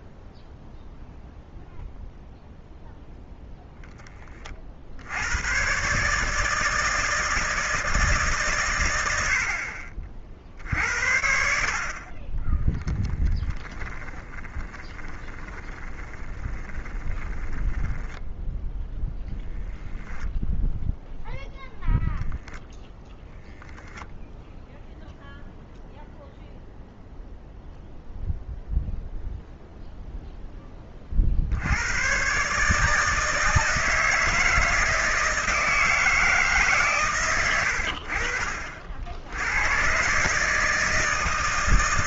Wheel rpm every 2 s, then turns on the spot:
0, 0, 50, 150, 130, 60, 10, 20, 20, 0, 0, 0, 0, 0, 0, 0, 140, 160, 140, 50, 150.
12-18